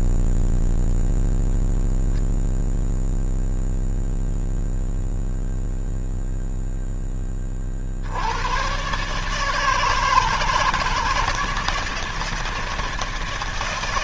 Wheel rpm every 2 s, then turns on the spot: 0, 0, 0, 40, 150, 160, 160.
none